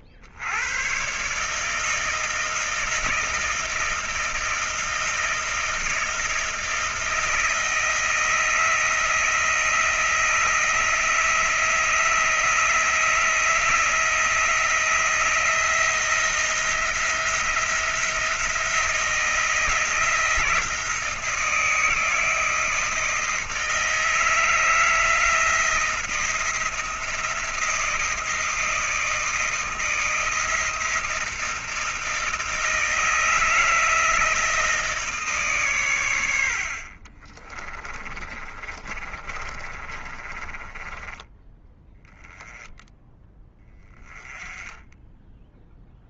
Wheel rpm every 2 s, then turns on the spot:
90, 160, 160, 160, 160, 160, 160, 160, 170, 170, 160, 160, 160, 170, 160, 160, 160, 160, 110, 30, 30, 10, 20.
38-42